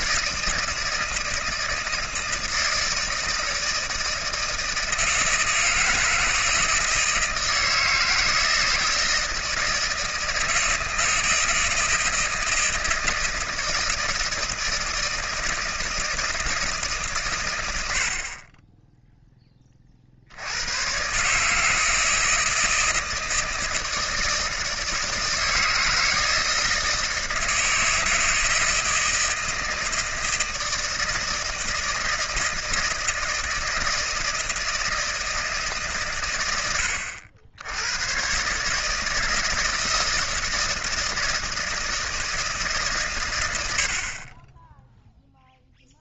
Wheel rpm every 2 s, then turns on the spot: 160, 160, 160, 160, 160, 160, 160, 160, 160, 20, 100, 160, 160, 160, 160, 160, 160, 160, 100, 140, 160, 150, 20.
none